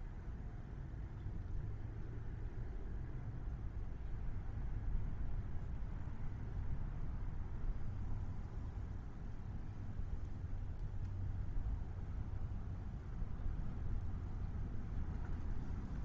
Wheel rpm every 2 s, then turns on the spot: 0, 0, 0, 0, 0, 0, 0, 0.
none